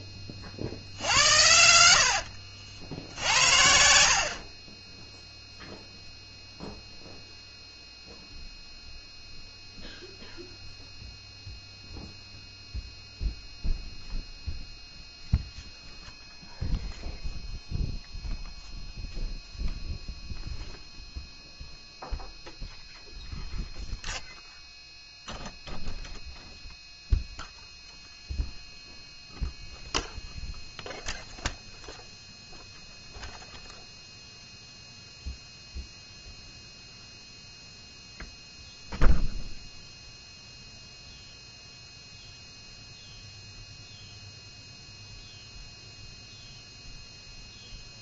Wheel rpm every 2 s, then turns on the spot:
40, 60, 20, 0, 0, 0, 0, 0, 0, 0, 0, 0, 0, 0, 0, 0, 0, 0, 0, 0, 0, 0, 0, 0.
2-4